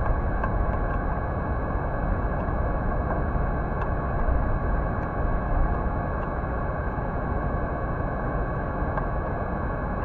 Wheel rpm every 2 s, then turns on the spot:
0, 0, 0, 0, 0.
none